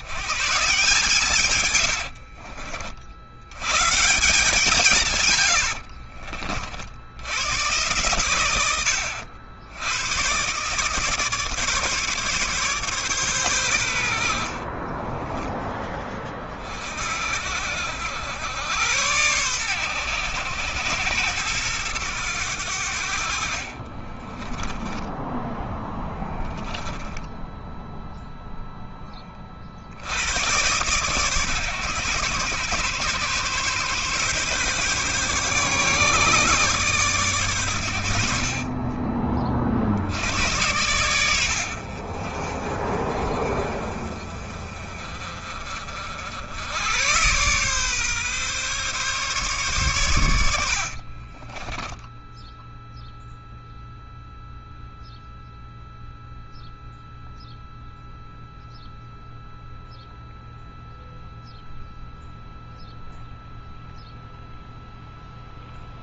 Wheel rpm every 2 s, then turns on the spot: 150, 60, 150, 70, 80, 140, 130, 30, 60, 110, 100, 70, 10, 10, 20, 130, 130, 140, 140, 40, 100, 40, 40, 100, 140, 40, 0, 0, 0, 0, 0, 0, 0.
14-16 24-26 50-52